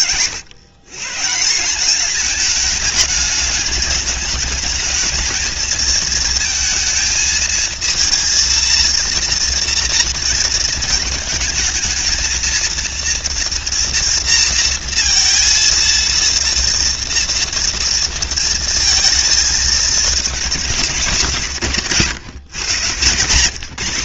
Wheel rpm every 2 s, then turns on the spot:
140, 210, 220, 220, 230, 220, 230, 230, 230, 220, 170, 130.
none